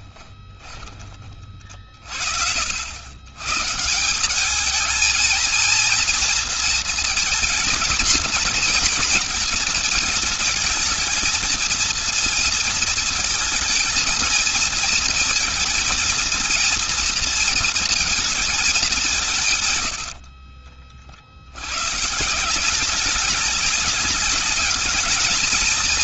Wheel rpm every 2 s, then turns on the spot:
20, 70, 210, 230, 230, 220, 230, 220, 230, 220, 50, 170, 220.
0-2 20-22